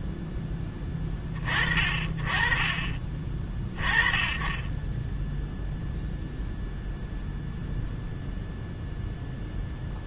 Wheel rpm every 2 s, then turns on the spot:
30, 30, 0, 0, 0.
none